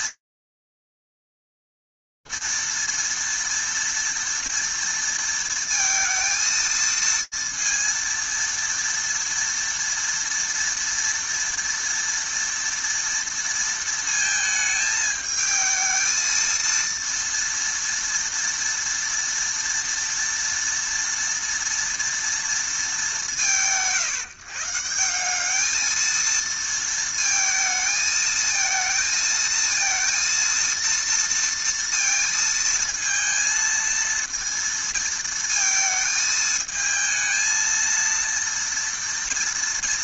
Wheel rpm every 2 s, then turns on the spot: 130, 230, 230, 230, 230, 230, 230, 230, 220, 230, 230, 230, 140, 220, 220, 230, 230, 230, 220, 230.
none